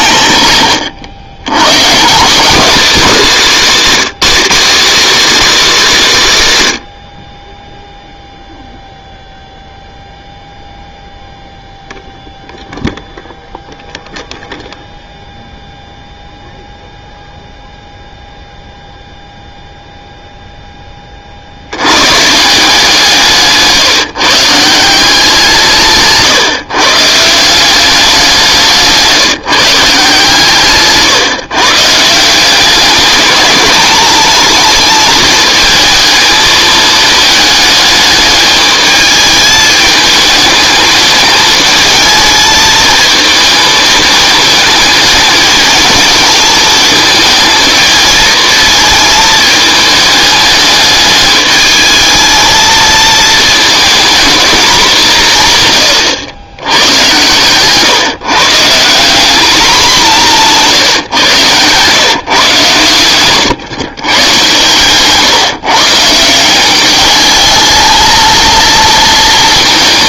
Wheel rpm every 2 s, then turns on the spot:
120, 250, 250, 180, 0, 0, 0, 0, 0, 0, 10, 160, 160, 150, 170, 140, 190, 220, 220, 210, 210, 220, 220, 220, 220, 220, 220, 210, 100, 160, 160, 130, 130, 180, 230.
60-62